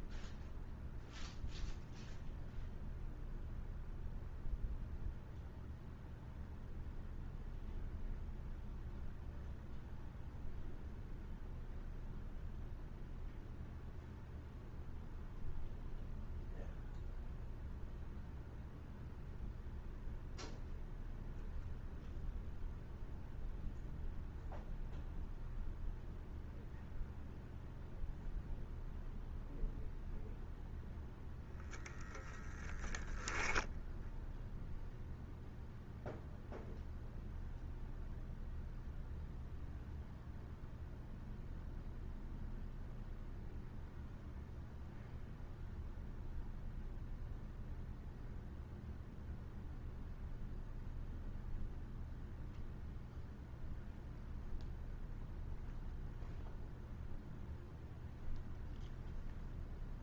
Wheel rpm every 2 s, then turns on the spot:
0, 0, 0, 0, 0, 0, 0, 0, 0, 0, 0, 0, 0, 0, 0, 0, 10, 0, 0, 0, 0, 0, 0, 0, 0, 0, 0, 0, 0, 0.
none